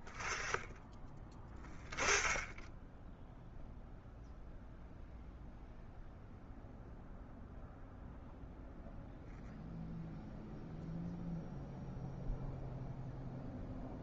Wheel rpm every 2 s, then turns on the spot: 20, 10, 0, 0, 0, 0, 0.
none